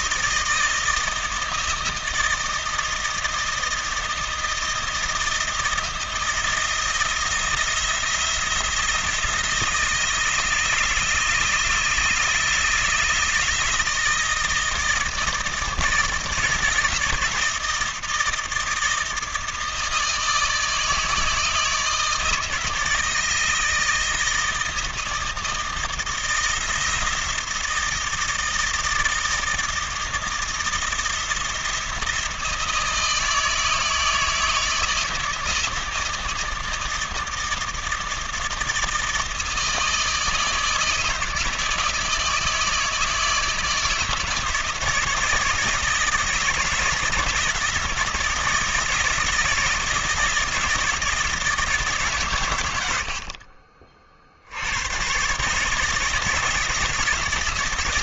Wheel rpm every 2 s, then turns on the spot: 160, 160, 160, 170, 170, 160, 160, 160, 160, 160, 160, 160, 160, 170, 160, 170, 160, 160, 160, 160, 160, 160, 160, 160, 160, 160, 110, 80, 160.
none